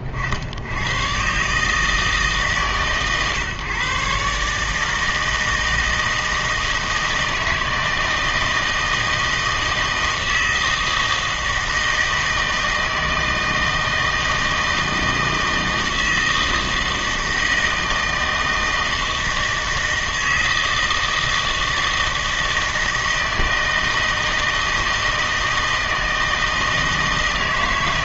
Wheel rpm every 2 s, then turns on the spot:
90, 150, 150, 160, 160, 160, 160, 160, 160, 160, 160, 160, 160, 160.
none